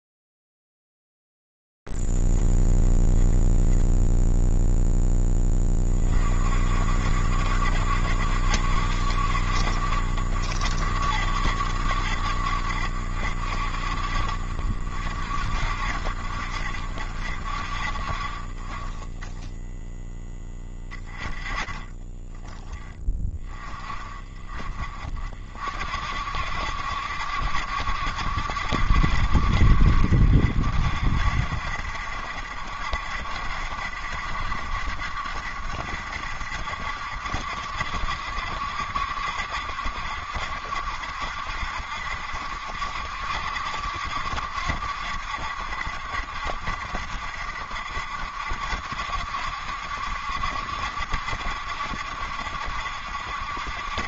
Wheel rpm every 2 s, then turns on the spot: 10, 20, 0, 20, 60, 60, 70, 50, 60, 40, 10, 10, 30, 60, 70, 60, 70, 60, 70, 70, 60, 70, 70, 70, 70, 70, 70.
20-22